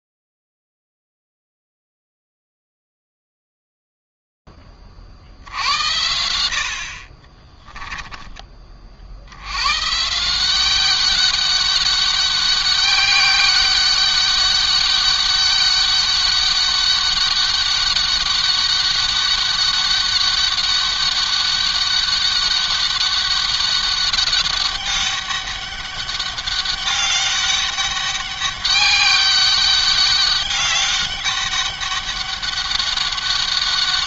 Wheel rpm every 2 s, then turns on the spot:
30, 0, 20, 70, 30, 180, 200, 200, 200, 200, 200, 200, 200, 200, 200, 200, 200.
none